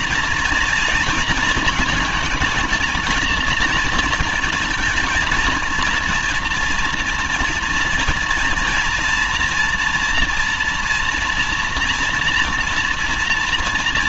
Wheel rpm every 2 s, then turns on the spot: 230, 230, 220, 230, 240, 230, 230.
none